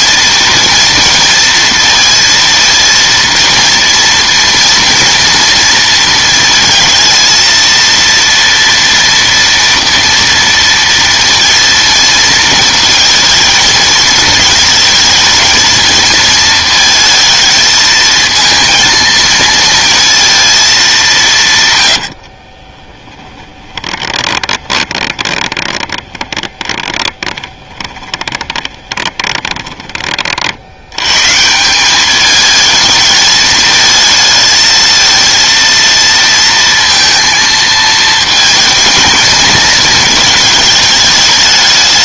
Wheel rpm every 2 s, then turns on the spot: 230, 230, 230, 230, 230, 230, 230, 220, 230, 230, 220, 30, 20, 20, 20, 60, 220, 220, 230, 230, 220.
22-30